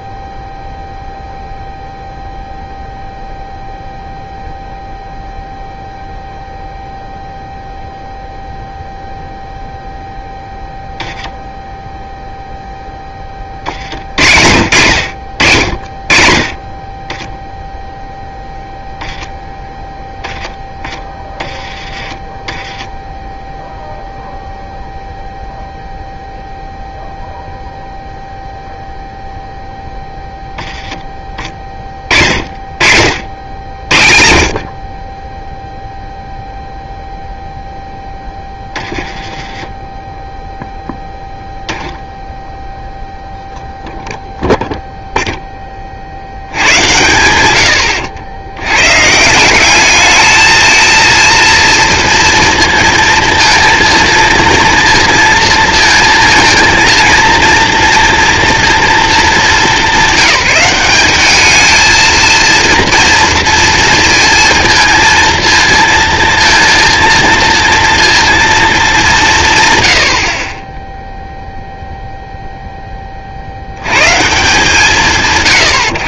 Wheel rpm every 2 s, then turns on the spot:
0, 0, 0, 0, 0, 0, 0, 80, 40, 0, 10, 10, 0, 0, 0, 10, 40, 50, 0, 20, 0, 0, 0, 90, 100, 220, 230, 230, 230, 230, 180, 230, 230, 230, 220, 30, 0, 160.
38-40 46-48